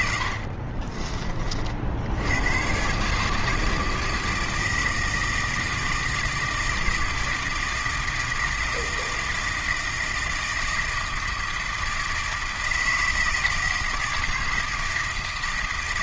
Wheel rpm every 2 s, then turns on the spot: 40, 120, 160, 160, 160, 160, 160, 160.
0-2